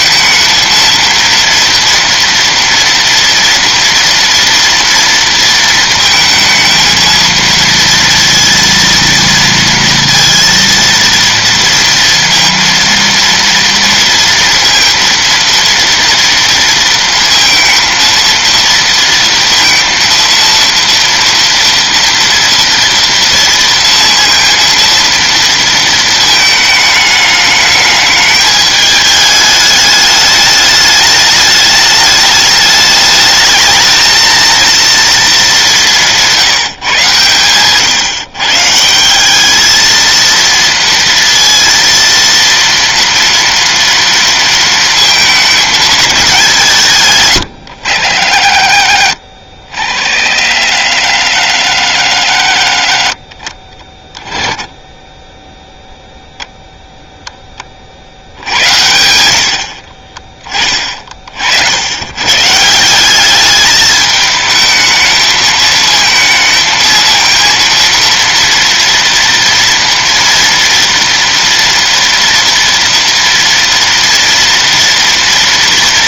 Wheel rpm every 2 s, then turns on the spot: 230, 230, 230, 220, 230, 230, 230, 230, 230, 230, 230, 230, 230, 220, 210, 210, 210, 230, 170, 150, 230, 230, 230, 170, 60, 80, 70, 10, 0, 80, 30, 160, 220, 220, 230, 230, 230, 230.
none